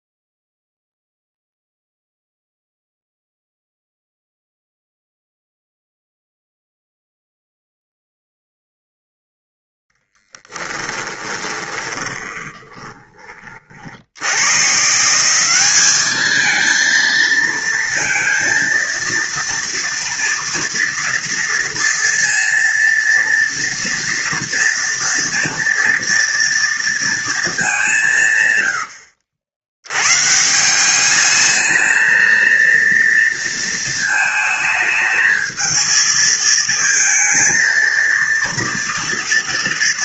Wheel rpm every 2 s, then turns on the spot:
0, 0, 0, 0, 0, 10, 20, 120, 220, 230, 230, 230, 230, 230, 110, 160, 230, 220, 220, 230.
10-14